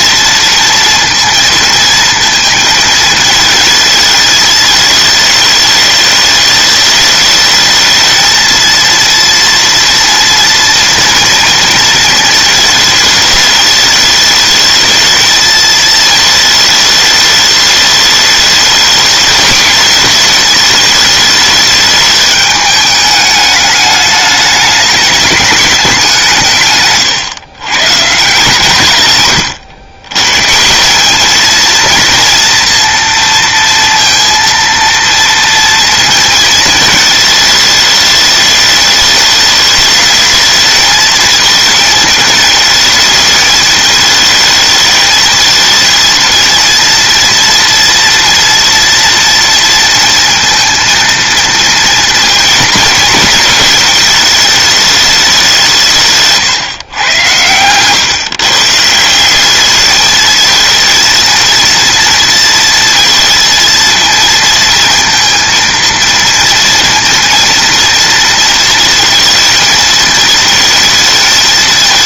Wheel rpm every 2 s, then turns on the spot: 230, 230, 220, 210, 220, 230, 230, 210, 220, 210, 210, 210, 210, 180, 140, 120, 230, 230, 230, 210, 210, 220, 220, 230, 230, 230, 230, 220, 150, 140, 210, 230, 230, 230, 230, 220.
none